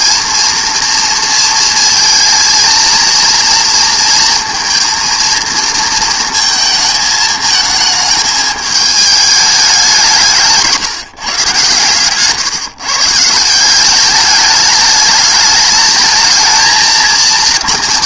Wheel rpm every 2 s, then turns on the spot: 230, 230, 230, 220, 220, 170, 140, 210, 220.
none